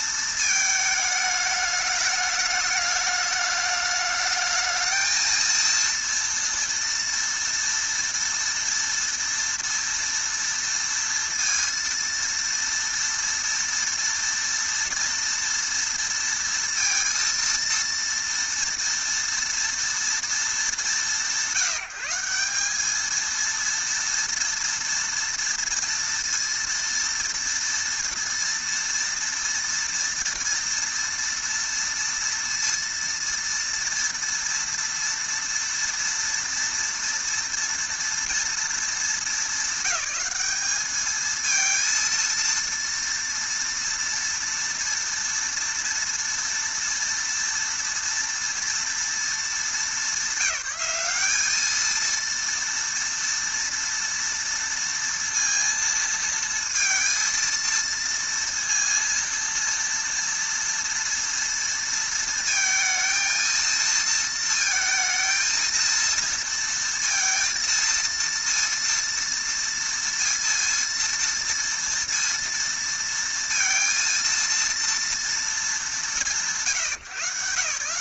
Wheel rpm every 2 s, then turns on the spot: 220, 210, 220, 230, 230, 230, 230, 230, 230, 230, 200, 210, 230, 230, 240, 240, 230, 230, 230, 220, 210, 230, 230, 230, 230, 200, 230, 230, 230, 230, 230, 230, 220, 230, 230, 230, 230, 230, 160.
none